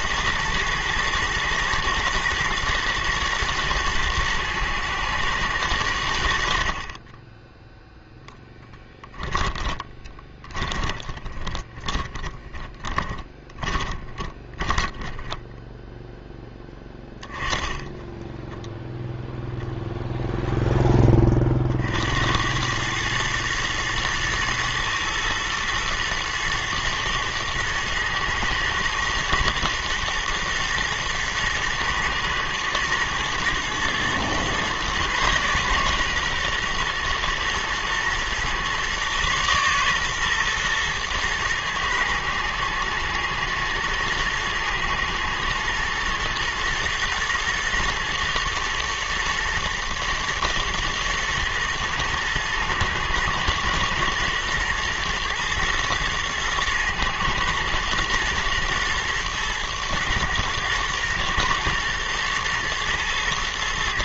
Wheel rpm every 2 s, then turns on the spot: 110, 120, 110, 50, 10, 20, 20, 20, 10, 10, 0, 100, 120, 120, 120, 120, 110, 120, 120, 120, 120, 110, 110, 110, 110, 110, 120, 120, 110, 110, 110, 110.
8-16